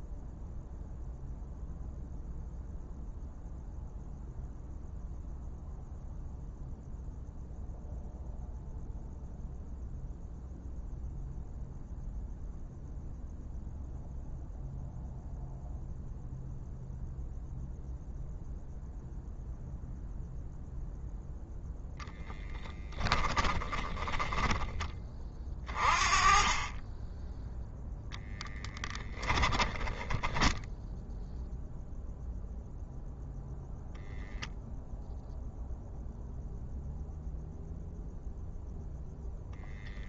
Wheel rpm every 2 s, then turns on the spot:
0, 0, 0, 0, 0, 0, 0, 0, 0, 0, 0, 10, 20, 10, 10, 0, 0, 0, 0, 0.
22-24 28-30